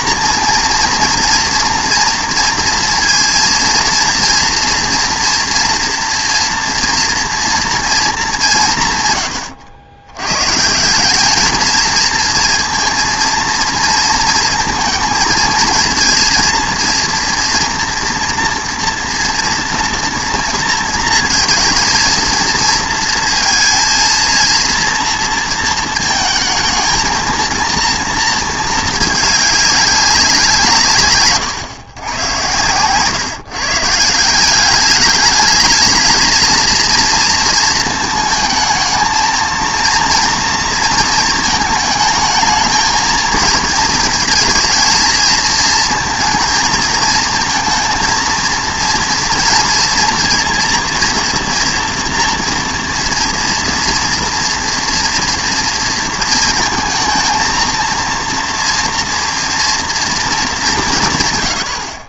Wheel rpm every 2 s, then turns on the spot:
230, 230, 240, 230, 150, 150, 230, 230, 230, 230, 230, 230, 230, 220, 220, 160, 110, 190, 230, 220, 230, 220, 230, 230, 230, 230, 230, 230, 220, 230, 190.
none